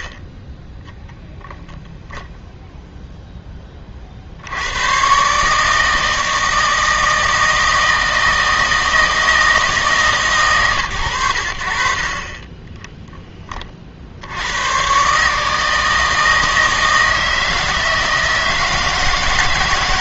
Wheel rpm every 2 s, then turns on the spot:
0, 0, 100, 160, 160, 120, 10, 120, 160, 160.
none